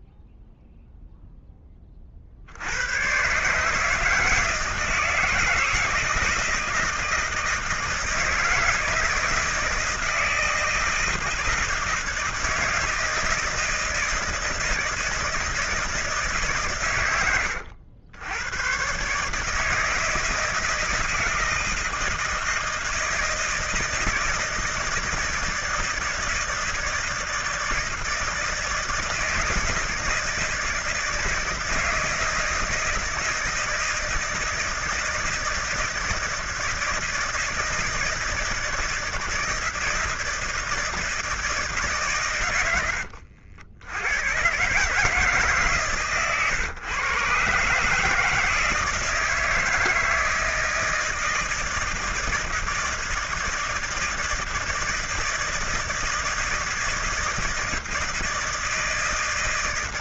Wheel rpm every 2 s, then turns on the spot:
0, 80, 160, 170, 160, 160, 160, 160, 130, 110, 160, 160, 160, 170, 160, 160, 160, 160, 160, 160, 160, 110, 140, 130, 160, 160, 160, 160, 160, 160.
none